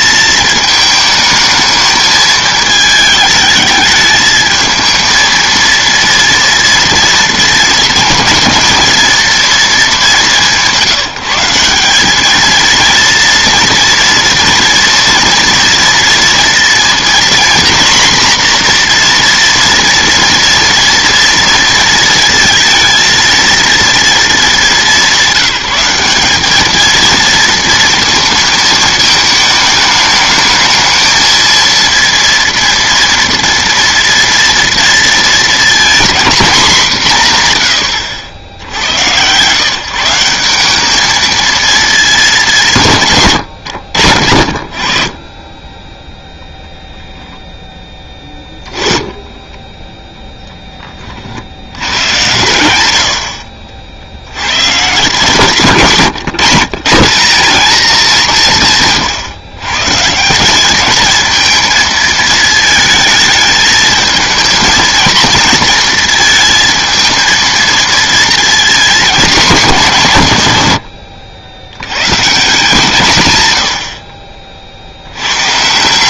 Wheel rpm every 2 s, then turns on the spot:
220, 220, 220, 230, 230, 180, 220, 230, 230, 240, 230, 230, 220, 210, 220, 220, 230, 230, 210, 70, 190, 190, 50, 0, 10, 10, 110, 110, 150, 170, 200, 220, 230, 230, 230, 120, 140, 50.
48-50